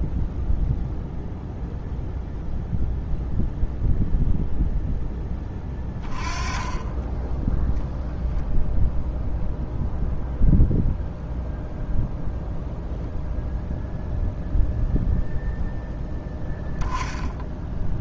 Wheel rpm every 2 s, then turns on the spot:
0, 0, 0, 20, 0, 0, 0, 0, 10.
none